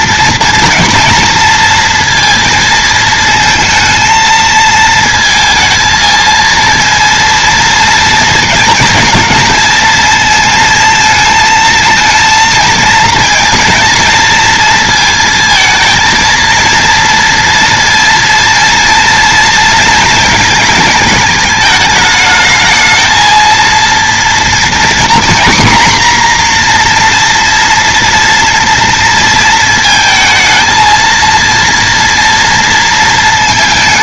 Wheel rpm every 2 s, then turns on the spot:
230, 230, 220, 230, 220, 230, 230, 230, 230, 230, 230, 220, 230, 240, 230, 230, 230.
none